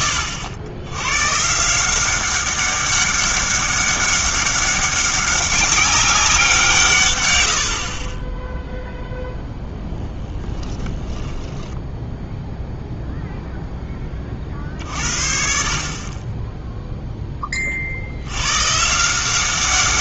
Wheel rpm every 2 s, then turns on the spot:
100, 200, 200, 150, 0, 20, 0, 50, 0, 130.
10-12